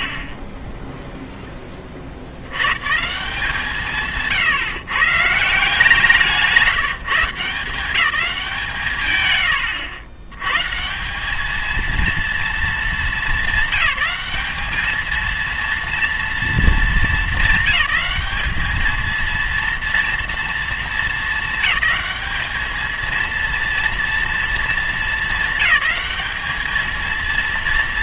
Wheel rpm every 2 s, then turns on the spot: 10, 120, 140, 180, 170, 150, 230, 220, 220, 220, 230, 210, 220, 220.
0-2